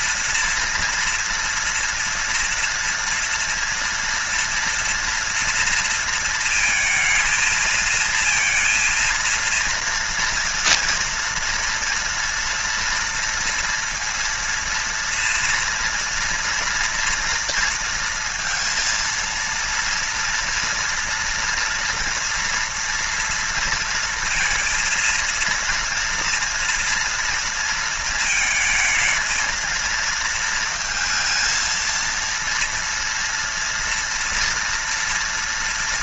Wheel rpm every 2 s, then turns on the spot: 240, 230, 230, 230, 230, 230, 240, 230, 230, 230, 230, 230, 230, 230, 230, 220, 230, 230.
none